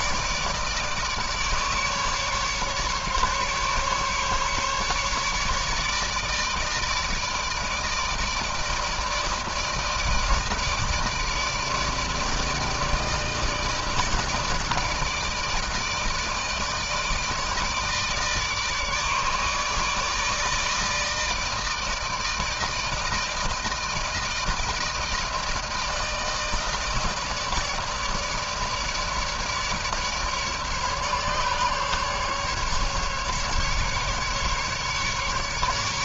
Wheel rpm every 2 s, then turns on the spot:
160, 150, 150, 150, 160, 160, 160, 160, 160, 150, 150, 160, 160, 160, 160, 150, 140, 150.
none